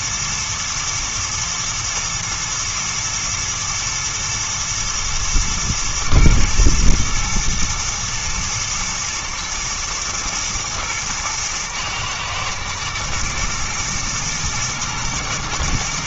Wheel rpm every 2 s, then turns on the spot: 110, 120, 120, 120, 120, 110, 110, 110.
none